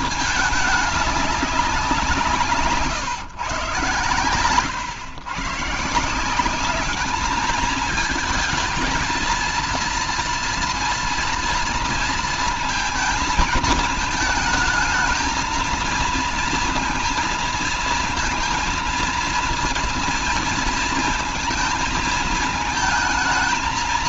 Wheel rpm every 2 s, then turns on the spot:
200, 140, 140, 210, 230, 230, 220, 220, 230, 230, 230, 230.
none